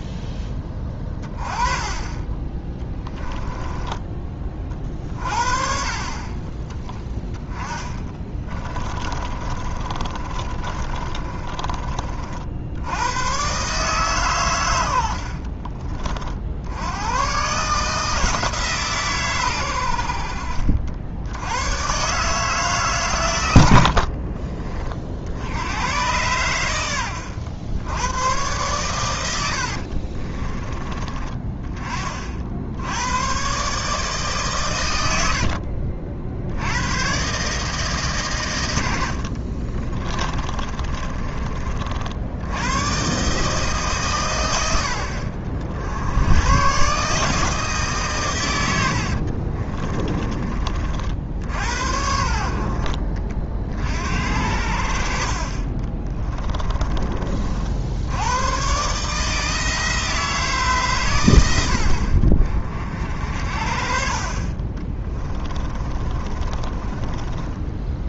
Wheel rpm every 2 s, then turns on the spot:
10, 10, 30, 20, 20, 30, 80, 100, 80, 150, 60, 140, 30, 100, 120, 30, 70, 140, 90, 100, 30, 100, 70, 120, 100, 40, 60, 60, 20, 130, 140, 40, 30, 30.
0-4 8-12 40-42 56-58 64-68